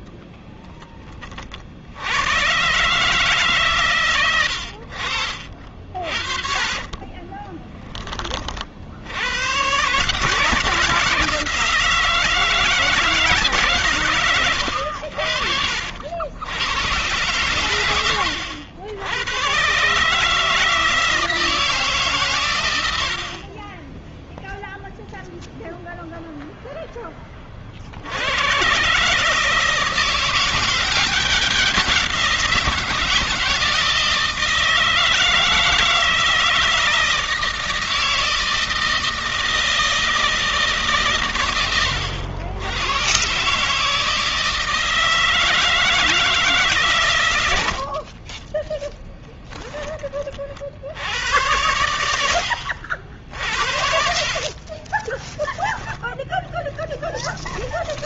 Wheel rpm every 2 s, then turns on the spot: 20, 140, 70, 30, 70, 160, 160, 70, 110, 90, 160, 110, 0, 10, 130, 190, 170, 160, 160, 160, 140, 100, 160, 140, 30, 70, 60, 30, 30.
4-8 14-16 48-50 54-58